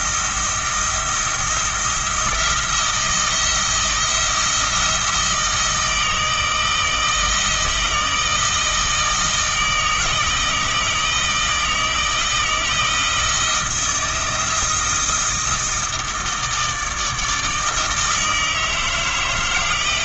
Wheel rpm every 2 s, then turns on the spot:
170, 170, 160, 160, 160, 160, 160, 170, 160, 160.
none